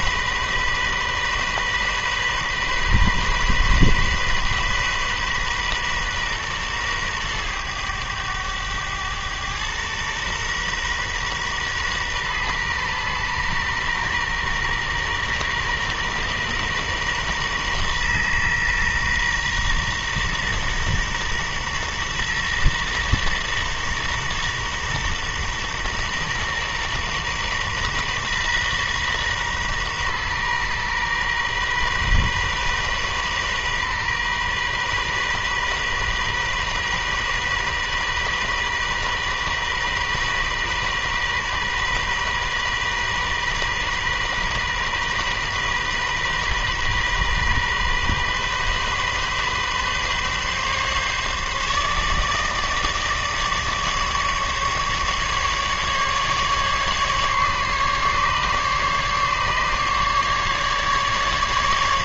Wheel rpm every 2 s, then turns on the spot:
130, 130, 130, 120, 100, 120, 120, 120, 120, 120, 120, 120, 120, 120, 120, 120, 130, 130, 130, 130, 130, 130, 130, 130, 130, 140, 150, 150, 140, 140, 150.
none